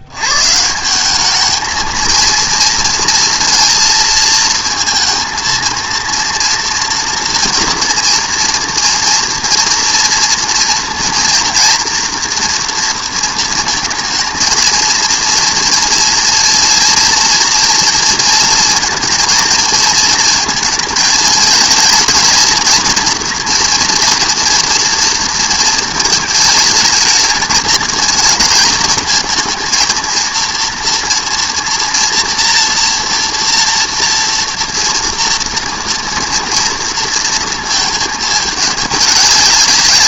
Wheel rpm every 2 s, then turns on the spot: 160, 230, 230, 240, 230, 240, 240, 230, 230, 230, 230, 230, 230, 220, 230, 230, 230, 230, 230, 210.
none